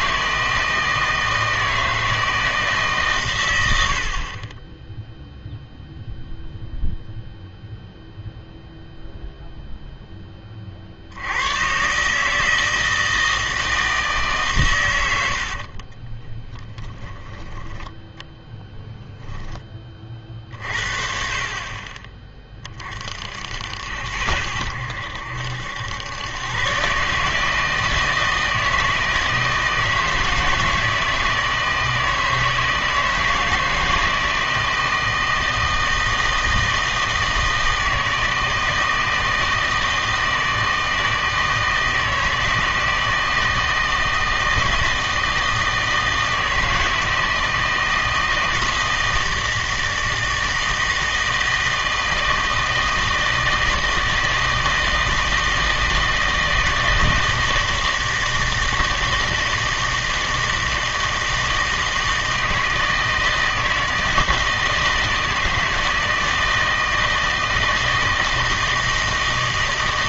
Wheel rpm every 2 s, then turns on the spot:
160, 150, 20, 0, 0, 40, 160, 120, 20, 0, 50, 30, 80, 130, 160, 160, 160, 160, 160, 160, 160, 160, 160, 160, 160, 160, 160, 160, 160, 160, 170, 160, 160, 160, 160.
16-18